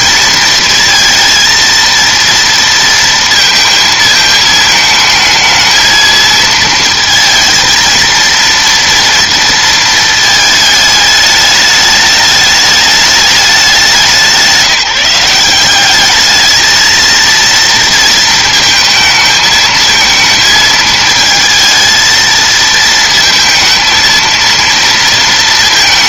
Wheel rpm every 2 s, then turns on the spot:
230, 230, 220, 220, 230, 210, 210, 170, 230, 220, 220, 230, 230.
none